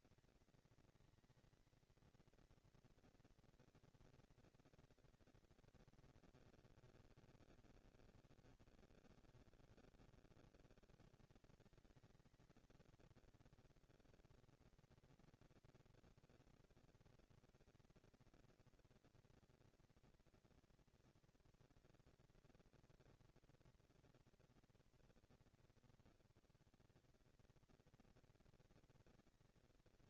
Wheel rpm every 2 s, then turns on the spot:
230, 230, 240, 210, 160, 170, 210, 230, 230, 230, 230, 230, 230, 180, 230.
none